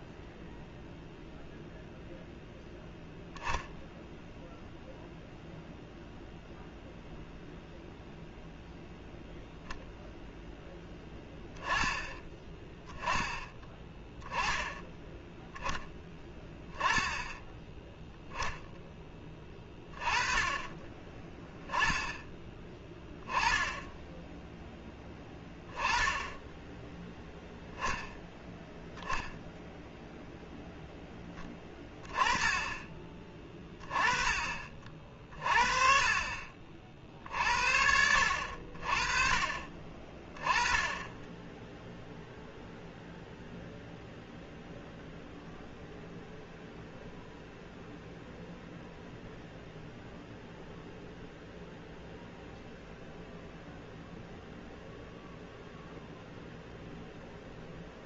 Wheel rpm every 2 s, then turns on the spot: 0, 0, 0, 0, 0, 10, 10, 20, 10, 10, 20, 10, 10, 10, 10, 0, 20, 40, 50, 40, 20, 0, 0, 0, 0, 0, 0, 0, 0.
none